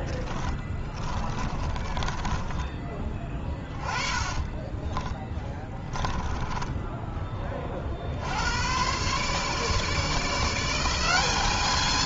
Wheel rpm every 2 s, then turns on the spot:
20, 20, 20, 10, 100, 170.
0-2 4-6